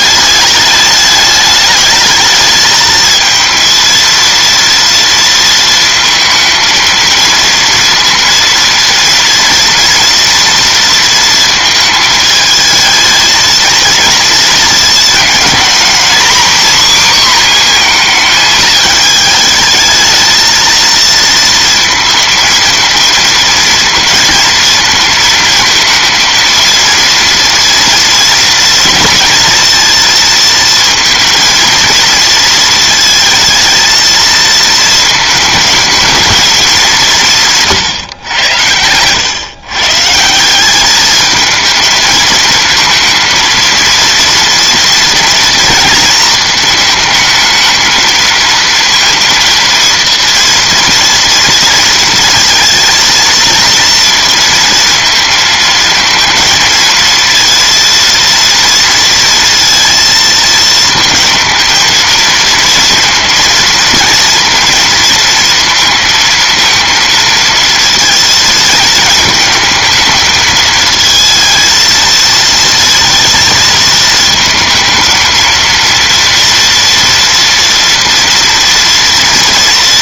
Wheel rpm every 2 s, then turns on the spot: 210, 220, 230, 220, 230, 230, 220, 220, 250, 220, 230, 230, 230, 230, 230, 230, 220, 220, 200, 110, 190, 230, 230, 220, 230, 230, 230, 230, 230, 230, 230, 230, 230, 230, 230, 220, 230, 220, 240, 230.
none